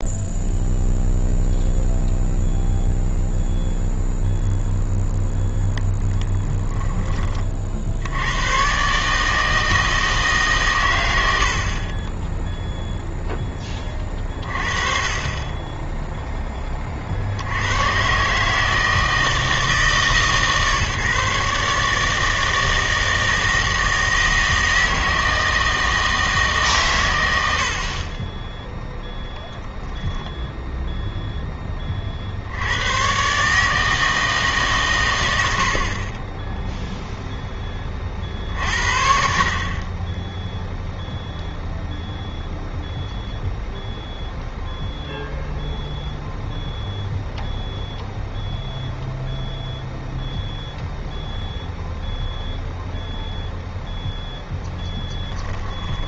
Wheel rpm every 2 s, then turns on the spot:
0, 0, 0, 10, 130, 120, 0, 30, 20, 150, 150, 160, 160, 140, 0, 0, 90, 130, 0, 60, 0, 0, 0, 0, 0, 0, 0, 10.
none